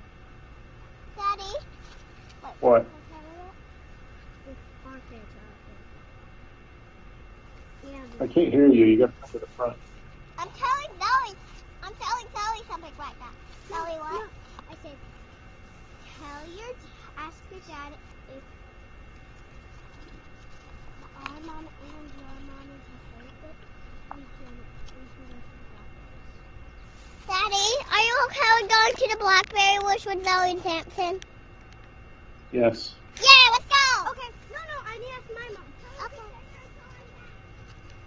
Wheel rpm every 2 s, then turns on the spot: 0, 0, 0, 0, 0, 0, 0, 0, 0, 0, 0, 0, 0, 0, 0, 0, 0, 0, 0.
none